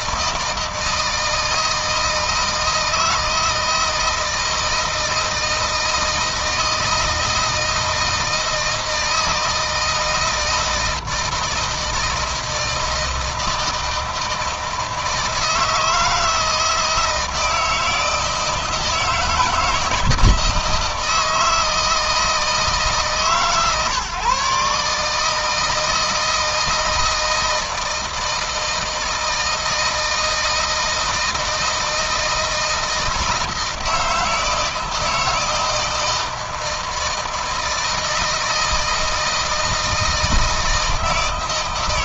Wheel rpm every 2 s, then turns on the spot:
160, 160, 160, 160, 160, 160, 160, 160, 160, 160, 160, 150, 140, 160, 160, 160, 160, 160, 160, 160, 160.
none